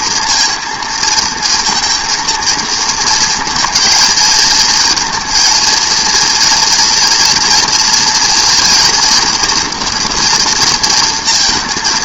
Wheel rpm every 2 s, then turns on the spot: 230, 230, 220, 230, 240, 230.
none